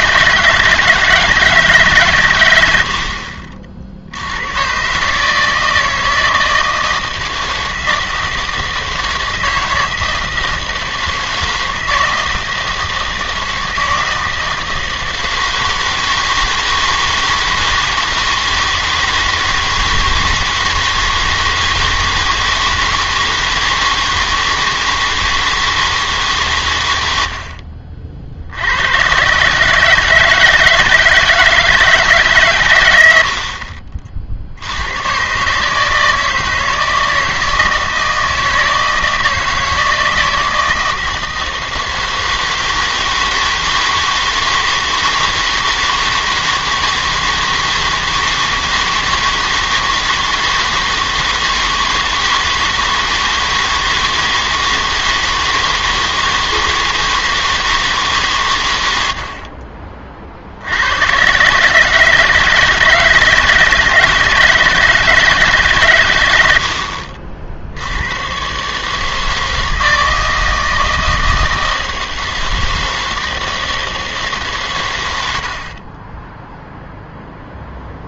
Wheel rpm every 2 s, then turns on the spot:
160, 90, 110, 160, 160, 160, 160, 160, 160, 160, 160, 160, 160, 120, 80, 160, 130, 80, 160, 160, 160, 160, 160, 160, 160, 160, 160, 160, 160, 120, 70, 160, 160, 80, 130, 160, 160, 140, 0.
none